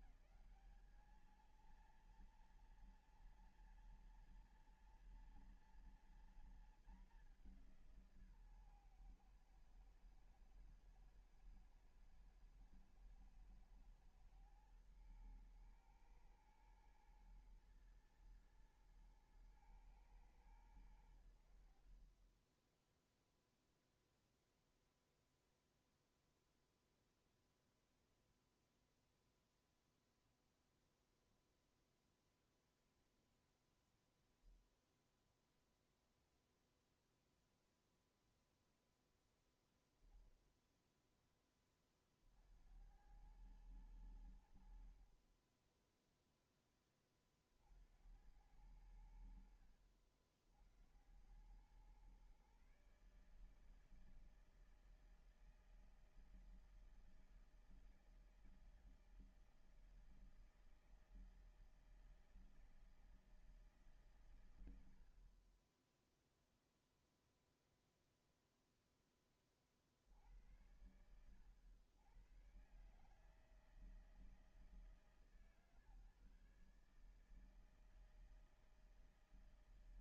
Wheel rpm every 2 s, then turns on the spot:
200, 230, 230, 220, 140, 110, 110, 110, 110, 120, 100, 10, 0, 0, 0, 0, 0, 0, 0, 10, 20, 70, 60, 10, 80, 70, 140, 160, 160, 160, 160, 160, 100, 0, 0, 80, 130, 160, 150, 160.
none